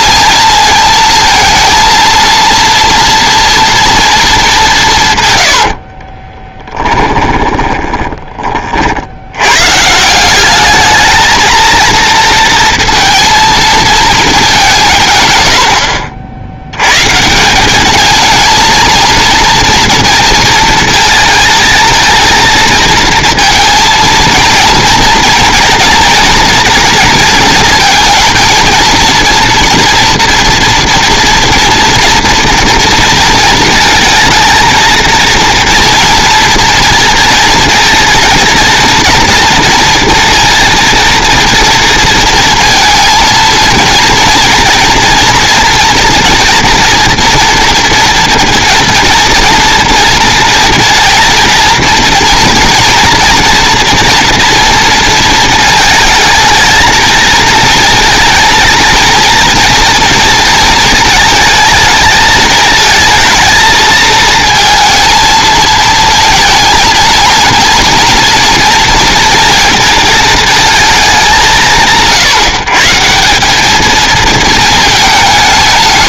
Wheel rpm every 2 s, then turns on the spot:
230, 230, 170, 10, 50, 210, 230, 180, 110, 230, 220, 230, 230, 230, 230, 240, 230, 230, 230, 230, 230, 230, 230, 230, 230, 230, 230, 230, 230, 230, 220, 220, 230, 230, 230, 220, 160, 220.
6-8